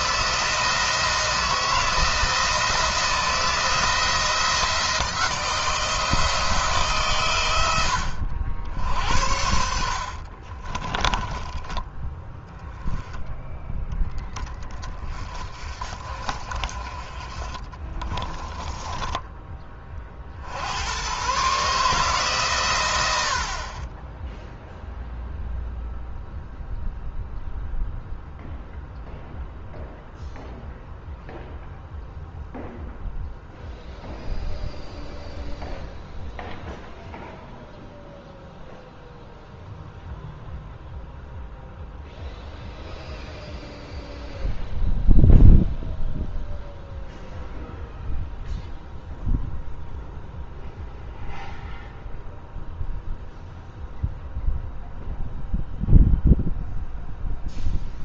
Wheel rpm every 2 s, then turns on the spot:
170, 170, 160, 140, 80, 30, 10, 20, 30, 10, 100, 90, 0, 0, 0, 0, 0, 0, 0, 0, 0, 0, 0, 0, 0, 0, 0, 0, 0.
10-12 18-20